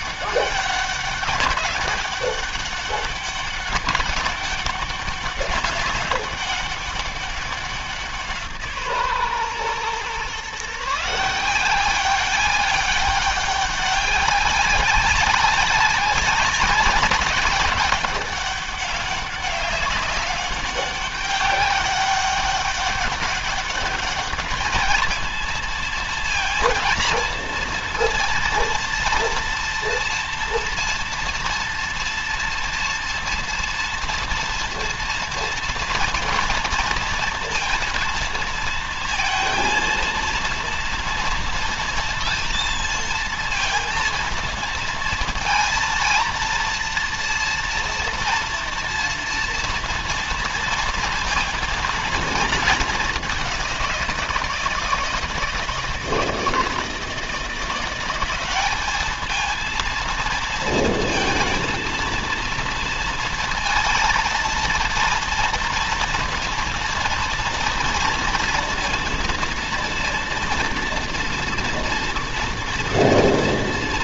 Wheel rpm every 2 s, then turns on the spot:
200, 200, 200, 190, 150, 150, 190, 190, 200, 200, 200, 200, 220, 230, 230, 230, 230, 230, 230, 230, 230, 230, 230, 230, 240, 230, 220, 170, 160, 210, 230, 230, 230, 230, 230, 230, 230.
none